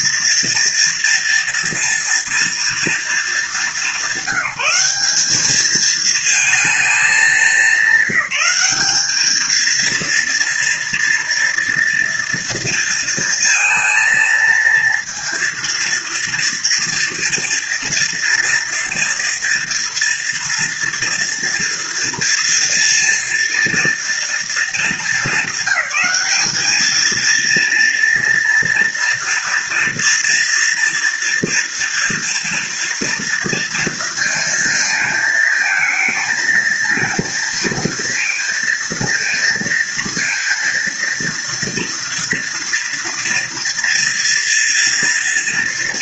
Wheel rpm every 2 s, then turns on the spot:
240, 230, 200, 220, 200, 230, 230, 230, 230, 230, 230, 230, 230, 210, 230, 230, 240, 230, 230, 230, 230, 230, 230.
none